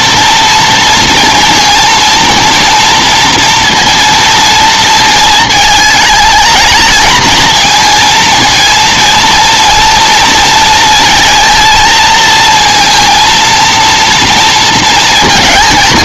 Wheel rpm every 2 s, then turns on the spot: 230, 230, 220, 220, 230, 230, 230, 230.
none